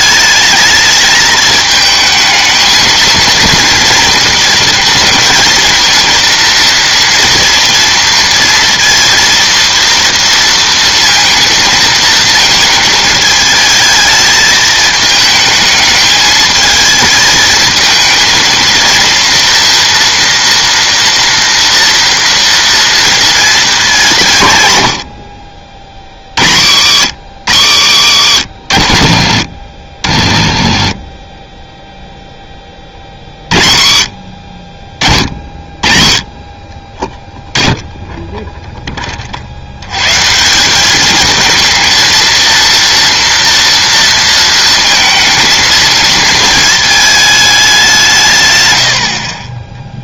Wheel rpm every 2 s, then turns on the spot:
210, 220, 230, 230, 230, 230, 220, 220, 220, 230, 240, 230, 150, 80, 80, 30, 20, 50, 30, 10, 190, 230, 230, 220, 120.
28-30